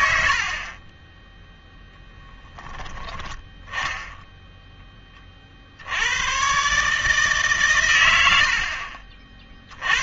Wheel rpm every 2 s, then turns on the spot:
50, 10, 10, 140, 60.
2-4